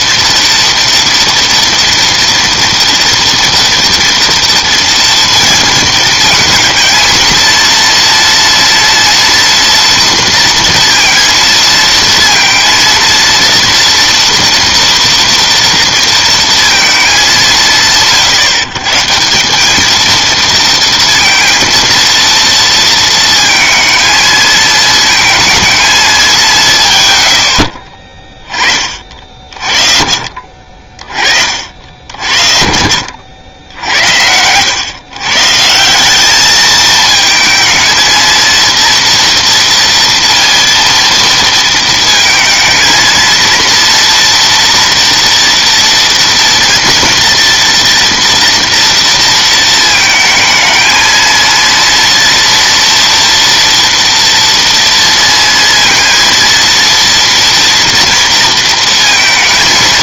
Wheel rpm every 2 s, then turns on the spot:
230, 230, 230, 230, 230, 230, 230, 230, 220, 140, 230, 230, 230, 130, 40, 40, 80, 140, 220, 230, 230, 230, 240, 230, 230, 230, 230, 230, 230, 230.
30-32